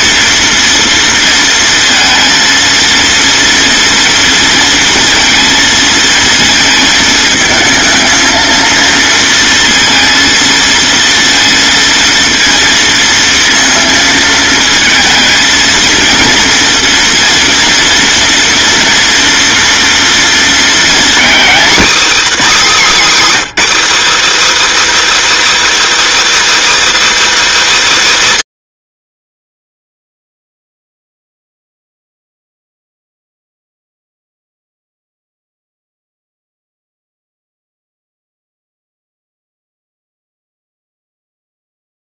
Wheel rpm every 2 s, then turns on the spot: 230, 230, 230, 220, 230, 230, 230, 220, 230, 230, 240, 270, 340, 340, 50, 0, 0, 0, 0, 0, 0.
none